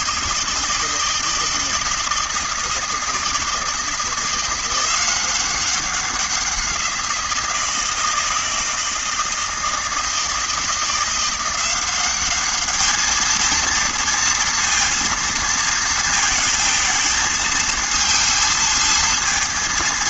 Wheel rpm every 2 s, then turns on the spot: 160, 160, 170, 180, 160, 160, 210, 230, 220, 230.
none